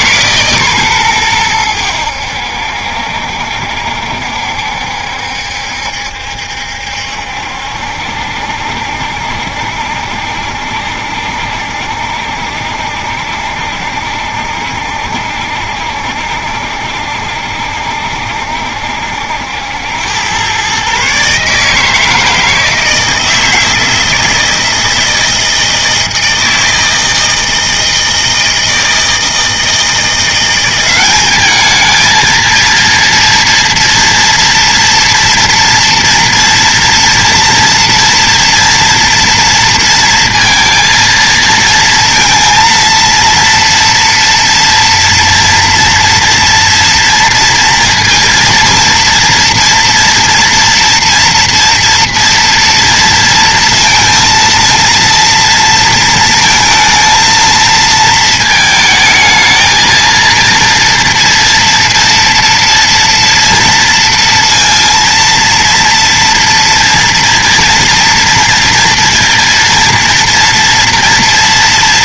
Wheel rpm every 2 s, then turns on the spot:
140, 70, 70, 70, 70, 70, 70, 70, 70, 70, 120, 160, 160, 160, 160, 180, 230, 230, 230, 230, 230, 230, 230, 230, 230, 230, 230, 230, 230, 220, 230, 230, 230, 230, 230, 230.
none